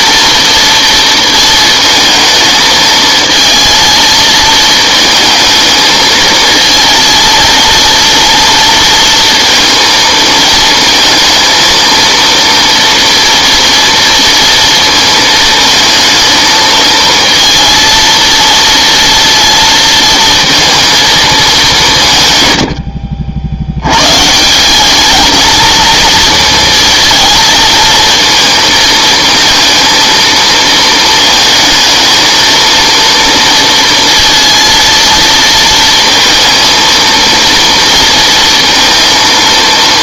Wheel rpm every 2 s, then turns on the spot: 230, 220, 220, 220, 230, 220, 230, 230, 220, 230, 230, 120, 170, 230, 230, 230, 230, 230, 230, 230.
none